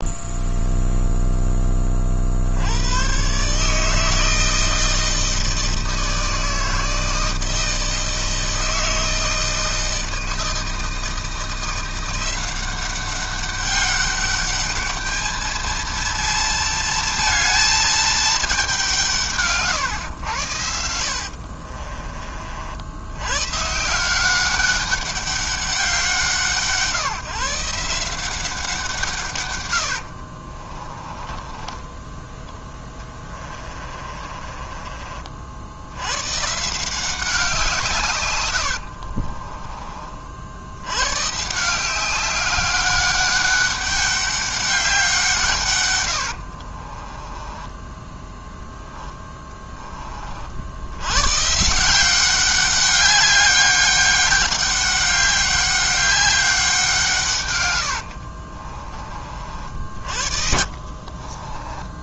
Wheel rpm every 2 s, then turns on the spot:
0, 90, 160, 160, 160, 160, 190, 210, 230, 190, 80, 80, 200, 160, 170, 30, 20, 30, 160, 80, 90, 200, 190, 40, 10, 80, 200, 200, 180, 40, 50.
20-22 30-36 38-40 46-50 58-62